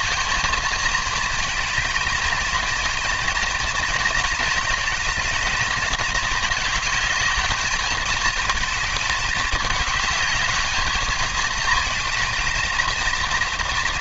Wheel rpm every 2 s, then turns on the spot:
220, 230, 220, 210, 210, 220, 230.
none